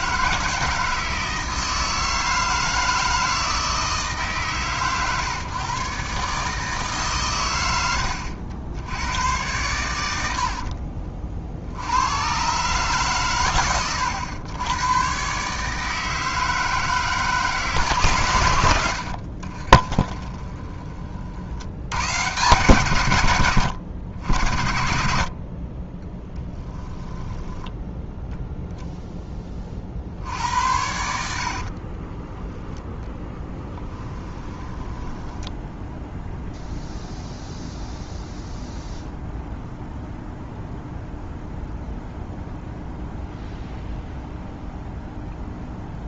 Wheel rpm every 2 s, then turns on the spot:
160, 160, 130, 140, 90, 50, 130, 100, 160, 80, 30, 120, 70, 20, 0, 80, 10, 10, 0, 0, 0, 0, 0.
10-12 26-28 34-36